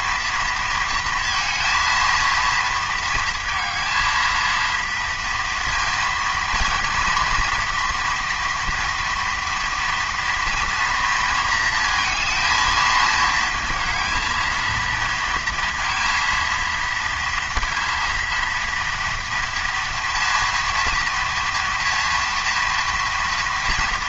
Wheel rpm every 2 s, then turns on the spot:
230, 230, 230, 230, 240, 230, 220, 230, 230, 230, 230, 240.
none